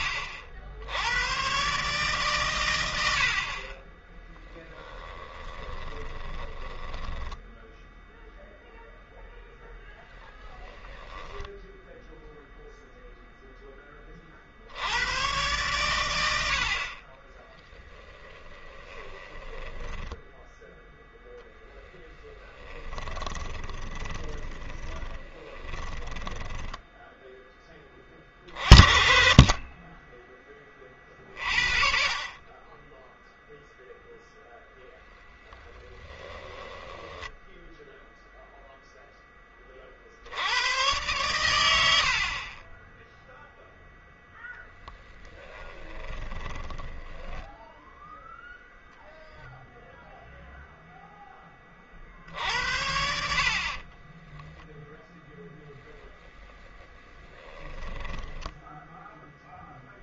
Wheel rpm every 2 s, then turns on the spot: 70, 110, 10, 10, 0, 10, 0, 70, 60, 20, 0, 10, 10, 10, 40, 30, 20, 0, 10, 0, 100, 20, 0, 20, 0, 0, 80, 10, 20, 10.
4-8 10-12 18-20 22-28 36-38 46-48 56-60